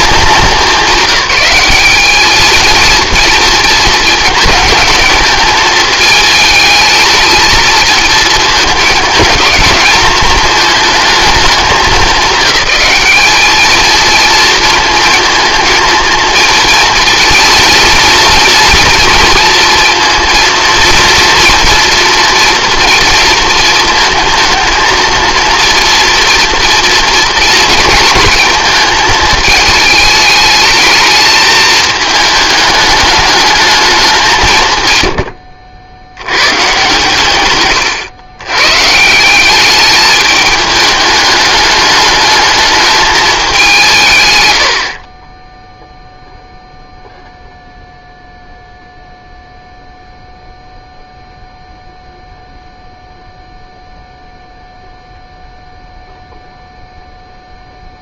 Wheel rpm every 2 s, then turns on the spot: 200, 220, 220, 220, 220, 220, 200, 220, 230, 230, 230, 230, 220, 230, 220, 220, 210, 130, 120, 140, 210, 220, 90, 0, 0, 0, 0, 0, 0.
none